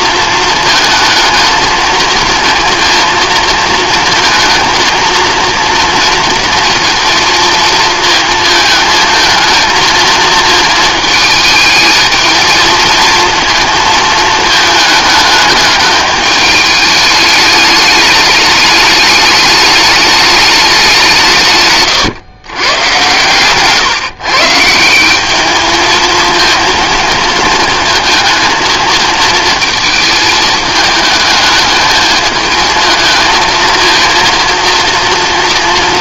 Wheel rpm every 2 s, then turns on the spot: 220, 230, 230, 230, 220, 230, 230, 220, 210, 210, 200, 120, 160, 230, 220, 220, 220, 230.
none